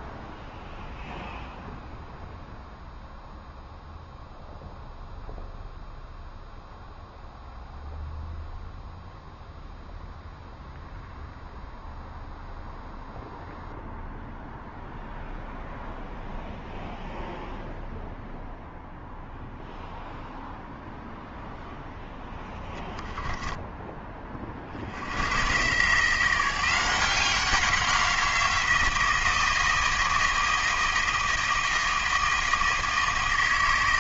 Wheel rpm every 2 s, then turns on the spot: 0, 0, 0, 0, 0, 0, 0, 0, 0, 0, 0, 20, 50, 180, 170, 160, 160.
22-24